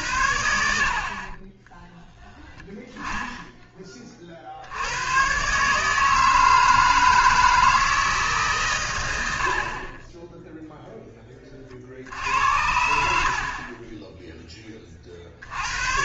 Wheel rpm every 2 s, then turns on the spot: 60, 10, 90, 160, 120, 0, 70, 30.
none